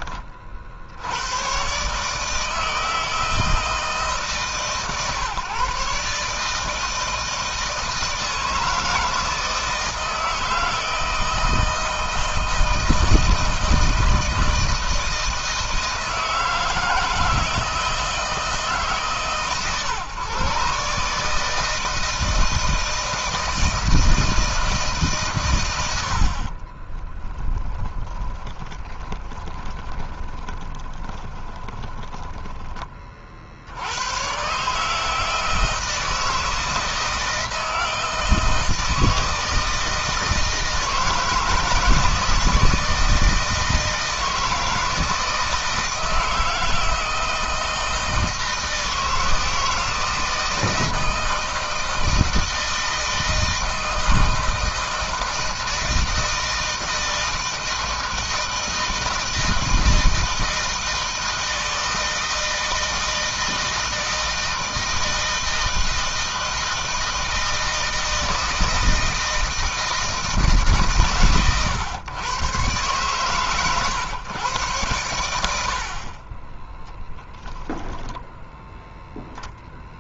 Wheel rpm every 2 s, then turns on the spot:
80, 160, 140, 160, 160, 160, 160, 160, 160, 150, 140, 160, 150, 30, 30, 20, 30, 150, 160, 160, 160, 160, 160, 160, 160, 160, 160, 160, 160, 160, 160, 160, 160, 160, 160, 130, 130, 100, 10, 10.
26-32 76-78